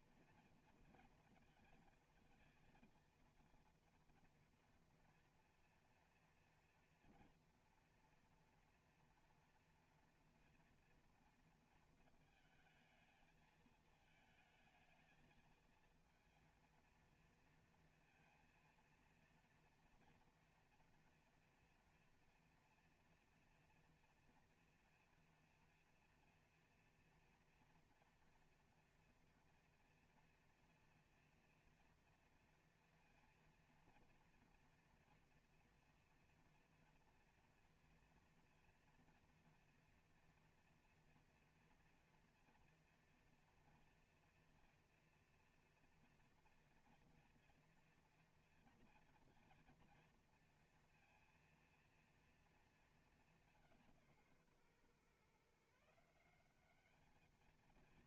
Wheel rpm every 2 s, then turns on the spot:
230, 230, 240, 240, 230, 230, 220, 230, 230, 230, 240, 230, 240, 240, 230, 230, 230, 230, 230, 230, 230, 240, 240, 230, 230, 230, 210, 130, 210.
none